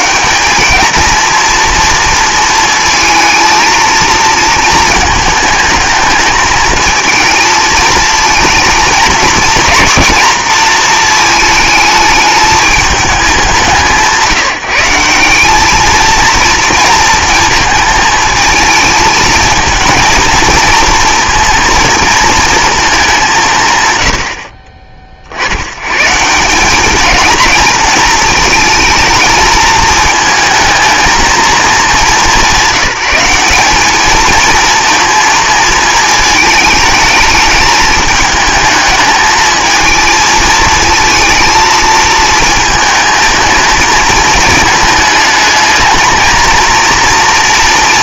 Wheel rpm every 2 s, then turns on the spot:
220, 230, 230, 220, 230, 230, 220, 170, 230, 220, 230, 220, 50, 190, 220, 220, 190, 230, 210, 210, 220, 220, 220, 230.
none